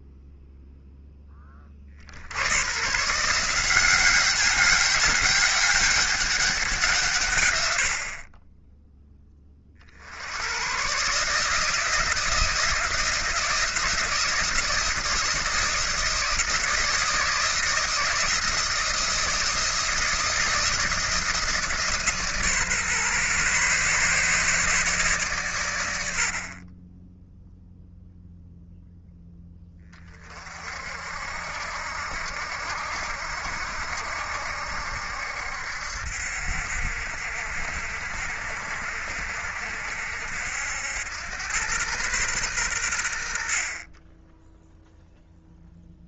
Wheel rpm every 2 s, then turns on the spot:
0, 120, 200, 170, 20, 120, 170, 160, 160, 160, 160, 140, 150, 20, 0, 50, 70, 70, 70, 70, 80, 100, 0.
none